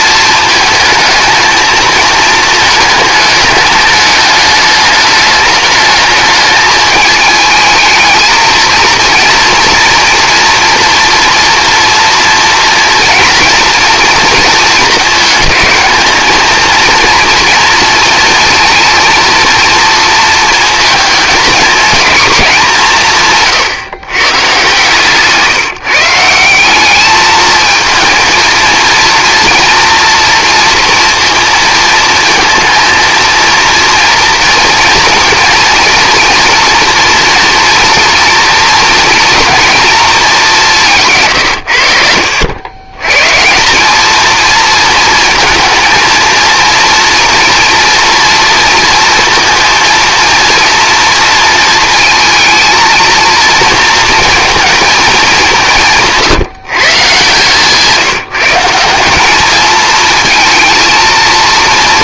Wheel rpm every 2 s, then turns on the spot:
220, 220, 210, 220, 230, 230, 230, 220, 230, 230, 230, 190, 130, 190, 230, 230, 230, 230, 230, 240, 190, 100, 230, 230, 230, 230, 230, 230, 160, 180, 230.
none